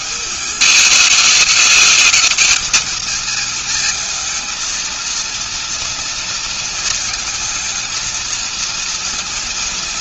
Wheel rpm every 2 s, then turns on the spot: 200, 220, 220, 230, 230.
none